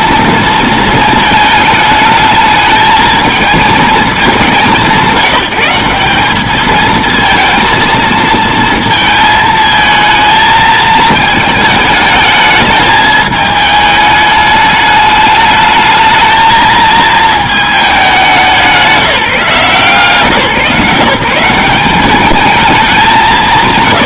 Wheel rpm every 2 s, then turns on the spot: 230, 220, 200, 210, 230, 220, 210, 210, 220, 200, 150, 210.
none